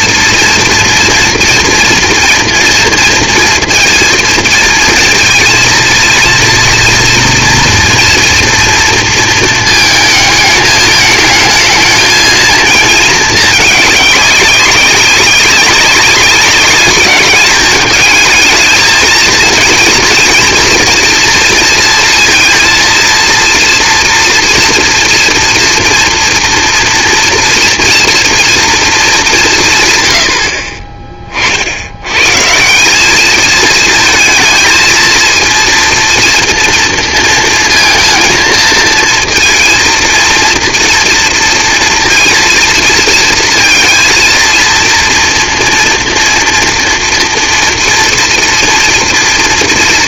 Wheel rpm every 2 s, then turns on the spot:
230, 240, 230, 230, 230, 210, 230, 200, 200, 220, 220, 230, 230, 230, 240, 60, 150, 230, 230, 230, 230, 230, 230, 230, 230.
none